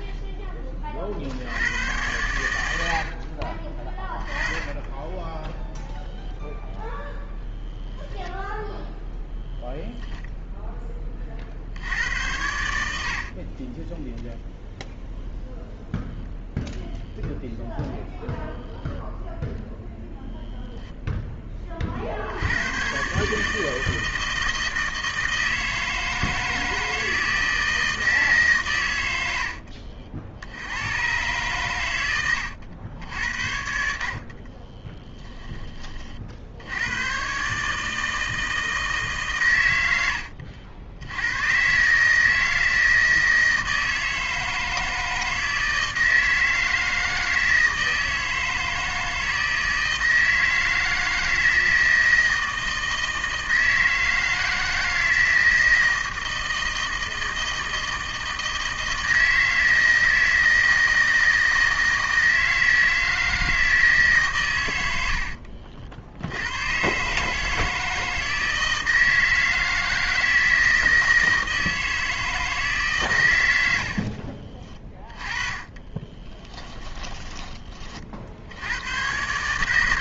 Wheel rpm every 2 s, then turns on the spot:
30, 80, 20, 0, 0, 10, 80, 0, 0, 0, 0, 100, 160, 160, 110, 100, 90, 20, 80, 160, 80, 160, 160, 160, 160, 160, 160, 160, 160, 160, 160, 160, 100, 120, 160, 160, 150, 30, 10, 100.
34-36 74-78